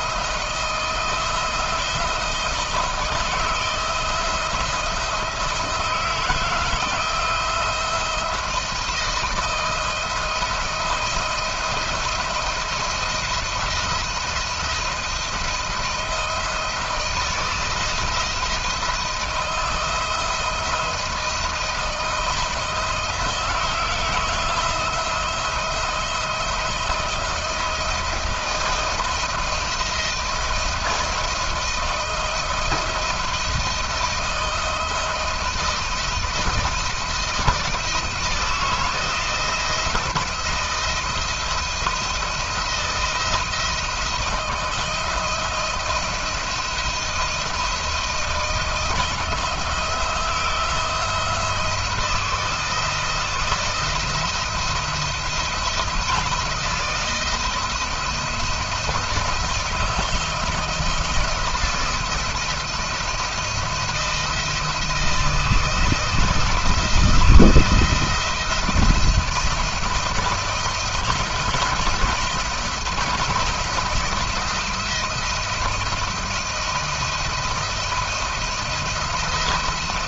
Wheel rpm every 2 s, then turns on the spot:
160, 160, 170, 160, 170, 170, 170, 170, 160, 170, 160, 160, 170, 160, 160, 160, 170, 160, 160, 160, 160, 170, 170, 170, 160, 170, 170, 170, 160, 170, 170, 160, 160, 160, 170, 170, 170, 170, 160, 170.
none